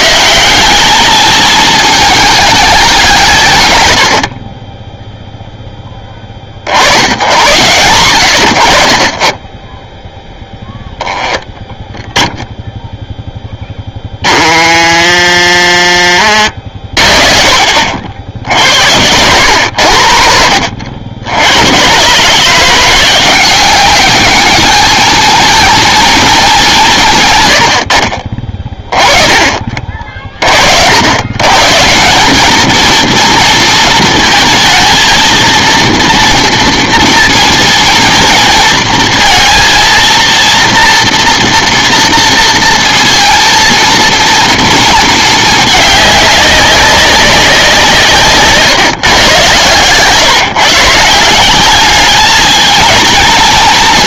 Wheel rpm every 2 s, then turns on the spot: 190, 210, 30, 50, 70, 0, 0, 20, 50, 70, 60, 160, 210, 190, 20, 50, 220, 220, 240, 230, 240, 230, 230, 200, 140, 140, 210.
28-30